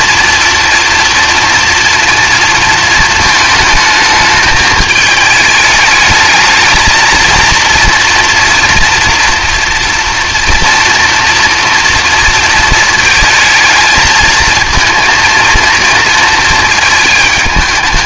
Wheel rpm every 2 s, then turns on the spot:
240, 230, 210, 220, 230, 230, 230, 230, 220.
none